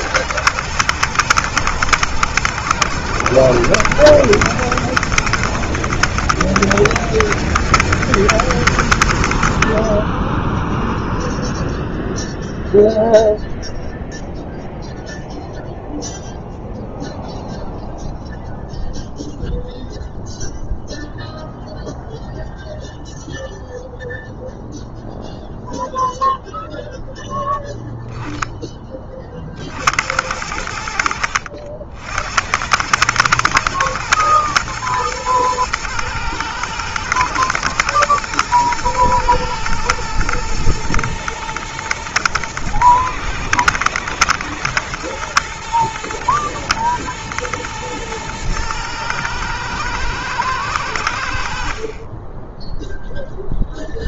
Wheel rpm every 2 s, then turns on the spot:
120, 120, 120, 110, 90, 0, 0, 0, 0, 0, 0, 0, 0, 0, 20, 70, 110, 110, 120, 120, 120, 120, 110, 120, 110, 90, 10.
none